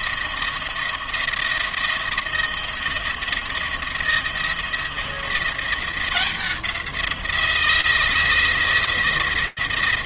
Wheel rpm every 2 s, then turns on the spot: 170, 170, 170, 180, 170.
none